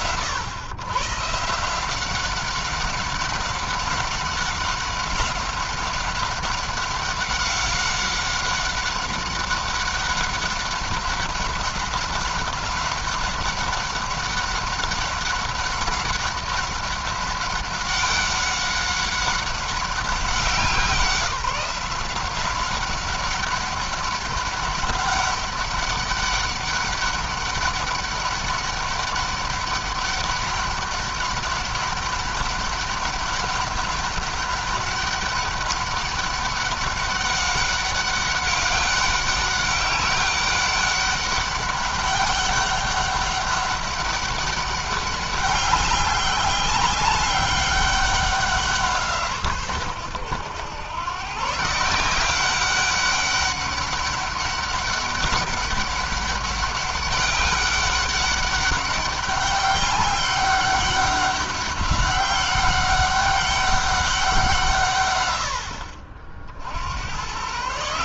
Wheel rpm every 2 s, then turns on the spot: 120, 190, 190, 200, 190, 190, 190, 190, 190, 190, 180, 190, 200, 200, 200, 200, 200, 200, 200, 190, 200, 200, 200, 200, 170, 120, 200, 200, 200, 200, 200, 190, 140, 90.
none